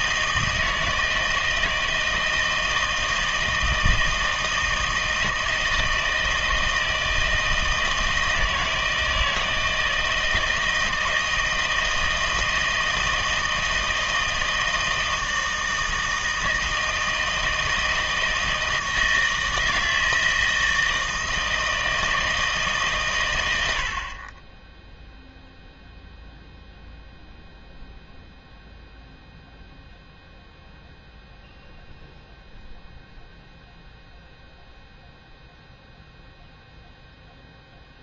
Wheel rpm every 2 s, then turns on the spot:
160, 160, 160, 160, 160, 160, 160, 160, 160, 160, 160, 150, 10, 0, 0, 0, 0, 0, 0.
none